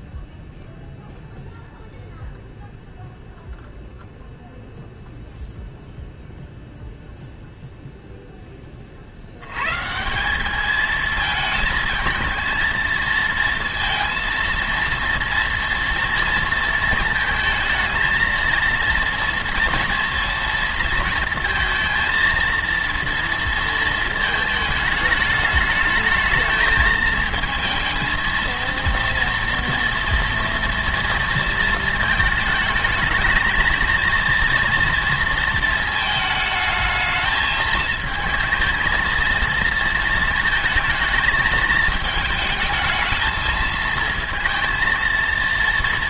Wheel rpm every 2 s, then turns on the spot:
0, 0, 0, 0, 20, 210, 220, 230, 230, 230, 230, 230, 220, 220, 230, 230, 220, 230, 220, 220, 220, 220, 230.
none